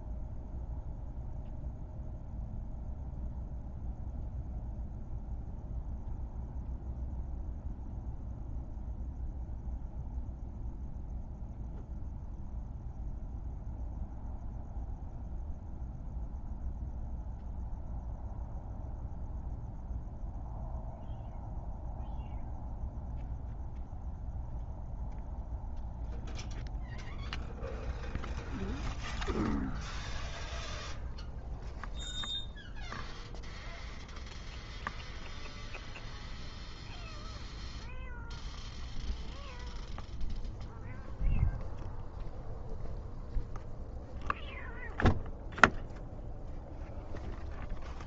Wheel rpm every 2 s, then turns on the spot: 0, 0, 0, 0, 0, 0, 0, 0, 0, 0, 0, 0, 0, 0, 0, 0, 0, 0, 0, 0, 0, 0, 0, 0.
none